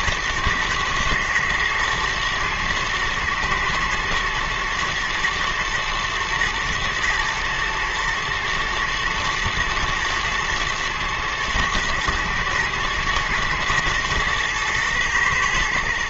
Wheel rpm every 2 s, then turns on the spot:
110, 110, 120, 120, 120, 110, 110, 110.
none